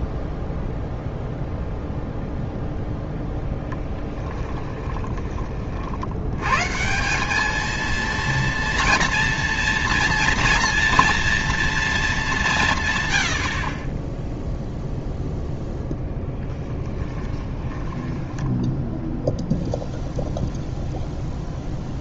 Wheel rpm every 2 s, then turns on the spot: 0, 0, 20, 140, 240, 230, 150, 0, 20, 10, 0.
4-6 16-18